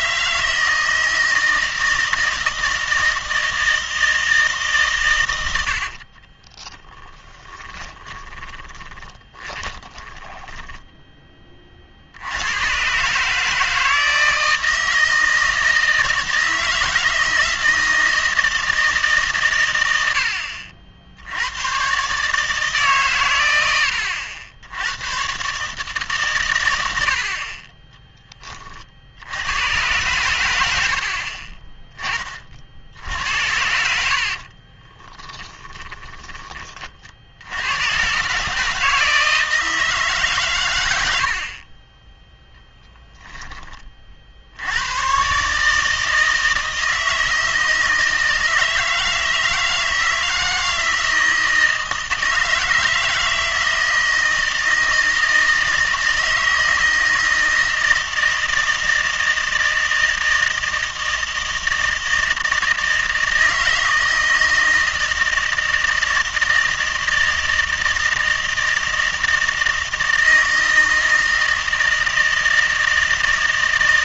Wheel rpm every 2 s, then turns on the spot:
160, 160, 140, 30, 20, 10, 120, 160, 160, 160, 70, 140, 80, 100, 40, 80, 50, 30, 30, 150, 110, 0, 90, 160, 160, 160, 160, 160, 160, 160, 160, 160, 160, 160, 160, 160, 160.
6-12 34-36